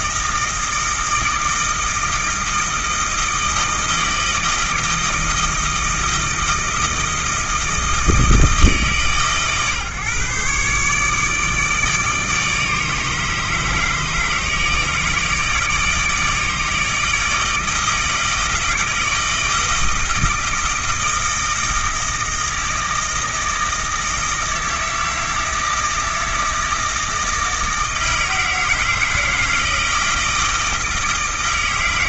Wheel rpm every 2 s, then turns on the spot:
160, 160, 160, 160, 150, 140, 150, 160, 160, 160, 160, 160, 160, 160, 160, 160.
none